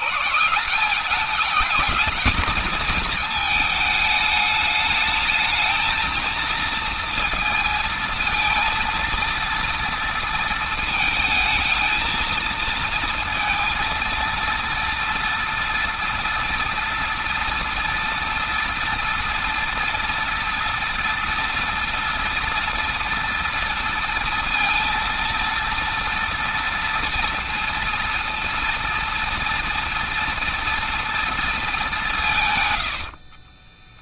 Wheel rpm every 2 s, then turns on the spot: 170, 220, 210, 230, 230, 220, 230, 230, 230, 230, 230, 230, 230, 230, 230, 230, 110.
32-34